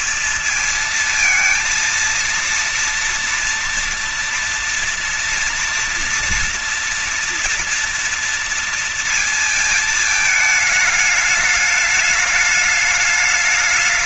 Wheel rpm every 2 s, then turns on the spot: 230, 230, 230, 230, 230, 220, 210.
none